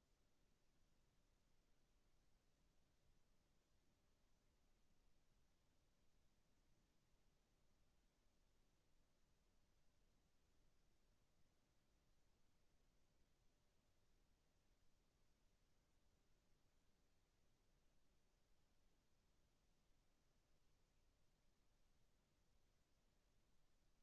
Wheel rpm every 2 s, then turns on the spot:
0, 0, 0, 0, 0, 0, 0, 0, 0, 0, 0, 0.
none